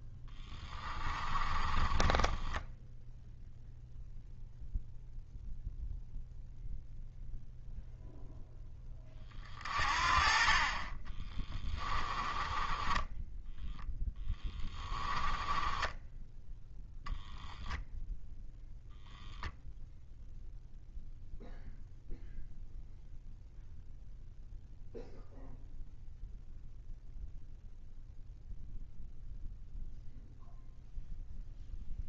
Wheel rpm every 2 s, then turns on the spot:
10, 10, 0, 0, 10, 30, 10, 10, 0, 0, 0, 0, 0, 0, 0, 0.
0-4 12-16